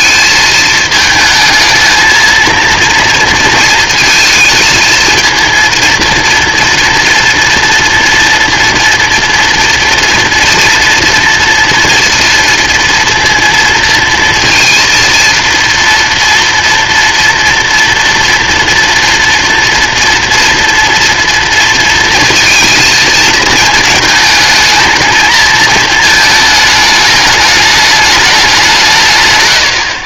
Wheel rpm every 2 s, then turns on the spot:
220, 230, 230, 230, 230, 230, 230, 230, 230, 230, 230, 220, 220, 220, 190.
none